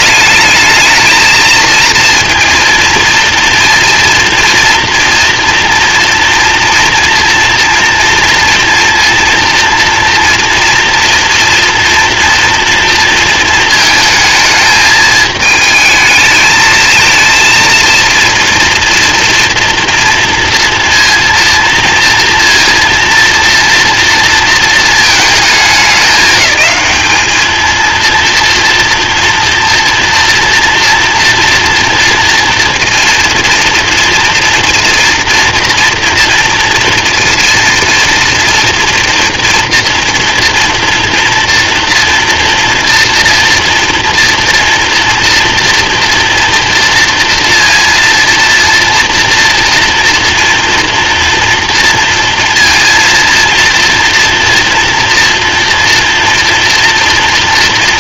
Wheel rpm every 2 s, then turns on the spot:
220, 240, 230, 230, 230, 230, 230, 220, 220, 230, 230, 230, 230, 210, 230, 230, 230, 230, 240, 230, 240, 230, 240, 230, 230, 230, 230, 240, 240.
none